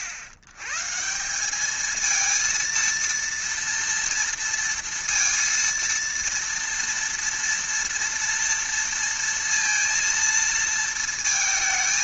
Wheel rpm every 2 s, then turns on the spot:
100, 230, 230, 230, 230, 230.
none